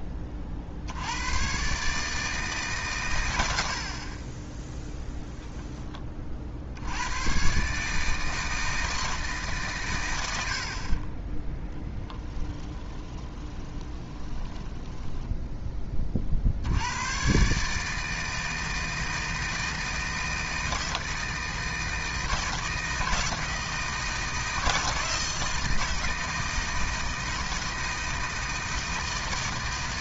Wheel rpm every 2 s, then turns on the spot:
60, 150, 10, 80, 160, 60, 20, 10, 80, 160, 160, 160, 160, 160, 160.
12-16